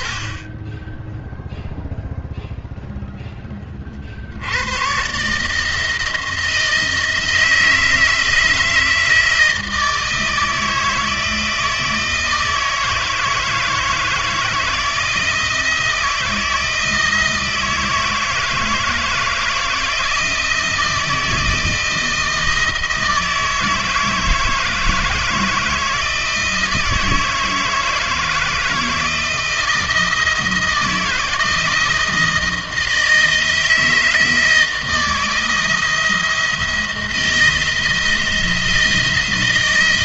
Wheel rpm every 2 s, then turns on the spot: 10, 0, 100, 160, 160, 160, 160, 160, 170, 160, 160, 160, 160, 160, 160, 160, 160, 160, 170, 170.
none